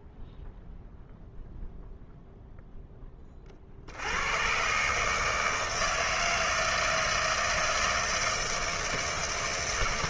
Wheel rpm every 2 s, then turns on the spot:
0, 0, 120, 160, 160.
none